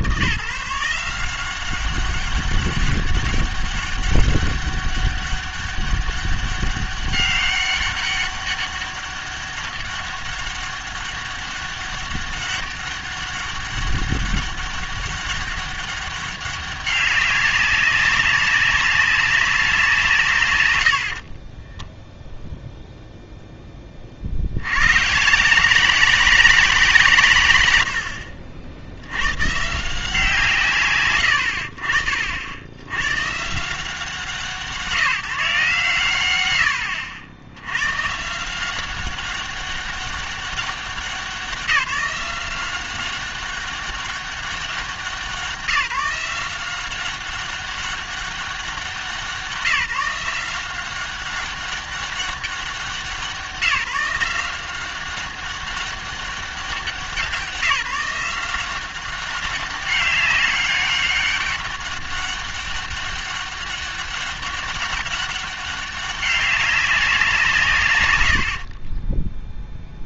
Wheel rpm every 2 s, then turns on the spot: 170, 200, 200, 200, 200, 200, 200, 200, 200, 200, 90, 0, 80, 180, 70, 140, 70, 170, 100, 180, 200, 190, 190, 180, 190, 180, 190, 180, 190, 190, 200, 200, 200, 190, 60.
none